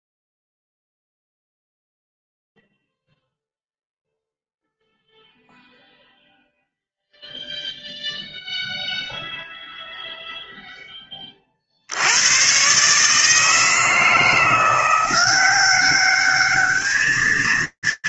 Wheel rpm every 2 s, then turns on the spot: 0, 0, 0, 0, 0, 0, 70, 160, 190.
none